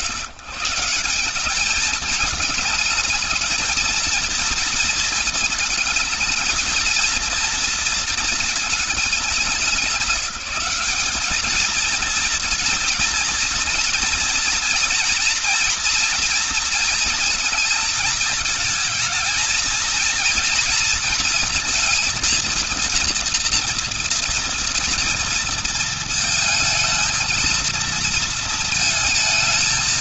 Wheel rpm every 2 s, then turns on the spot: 170, 220, 230, 220, 230, 190, 230, 230, 230, 220, 230, 230, 230, 220, 230.
none